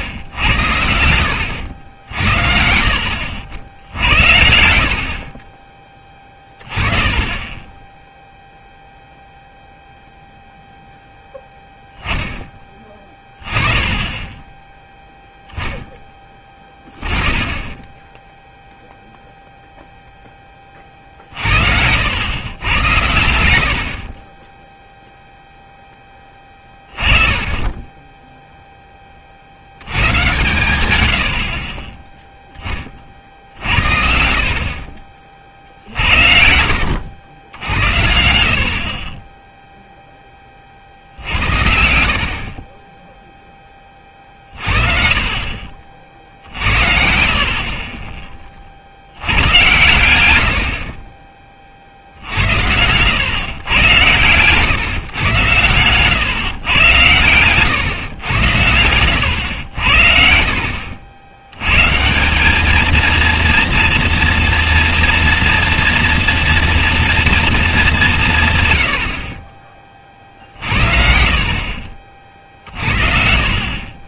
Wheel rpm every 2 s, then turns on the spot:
80, 60, 70, 20, 0, 0, 10, 10, 20, 0, 20, 100, 20, 20, 0, 120, 20, 50, 60, 60, 40, 30, 40, 70, 30, 70, 80, 130, 120, 100, 60, 200, 240, 230, 120, 50, 40.
0-2 42-46